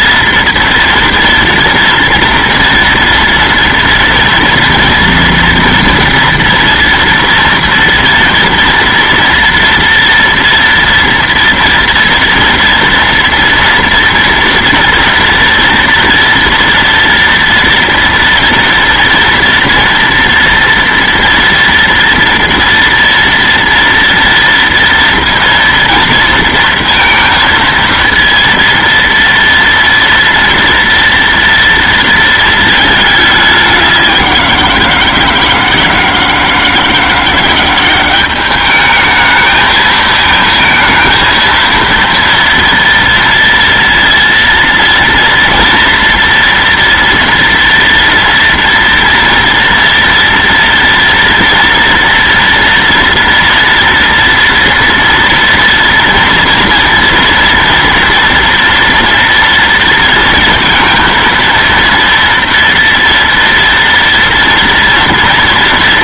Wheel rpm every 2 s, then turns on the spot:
230, 230, 230, 230, 230, 230, 230, 230, 230, 230, 230, 230, 230, 230, 230, 230, 220, 170, 170, 210, 220, 230, 230, 230, 230, 230, 230, 230, 230, 230, 230, 230, 230.
none